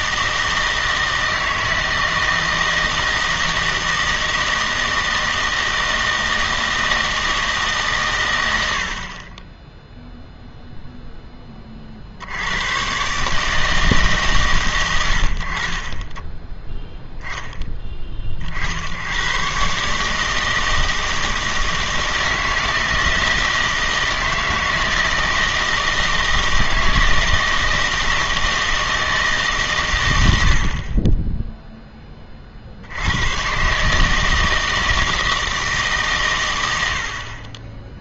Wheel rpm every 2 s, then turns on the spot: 160, 160, 160, 160, 100, 0, 100, 110, 10, 60, 160, 160, 160, 160, 160, 70, 50, 160, 90.
none